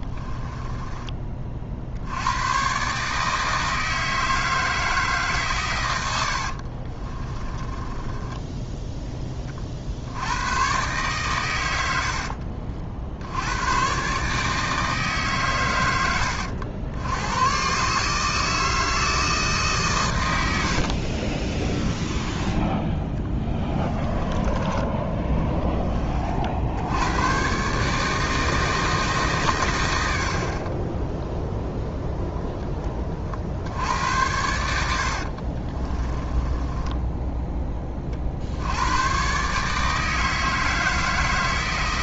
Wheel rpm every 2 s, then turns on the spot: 20, 130, 160, 50, 10, 120, 60, 150, 80, 160, 90, 20, 10, 80, 160, 30, 10, 80, 20, 80, 160.
6-10 20-24 34-38